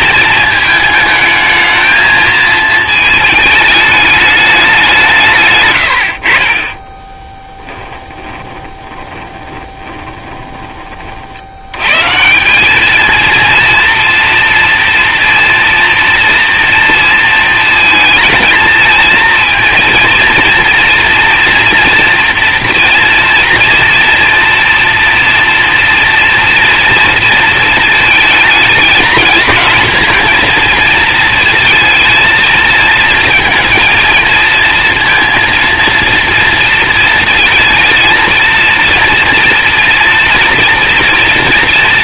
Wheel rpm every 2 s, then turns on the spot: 220, 220, 200, 30, 20, 20, 200, 230, 230, 220, 240, 230, 230, 240, 220, 230, 230, 230, 230, 230, 230.
8-10